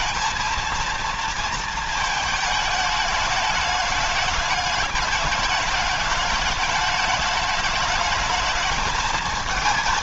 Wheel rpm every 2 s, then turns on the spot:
230, 210, 210, 210, 220.
none